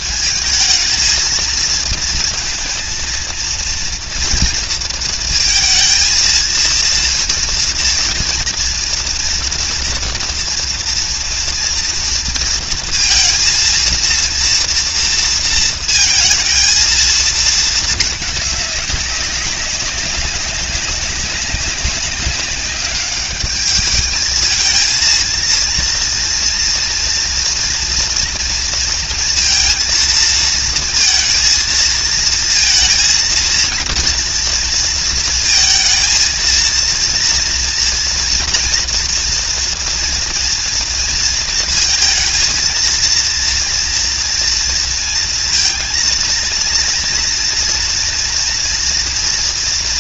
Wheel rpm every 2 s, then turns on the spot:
190, 220, 230, 230, 230, 230, 230, 230, 230, 220, 200, 200, 210, 230, 240, 230, 230, 240, 230, 230, 230, 230, 230, 230, 230.
none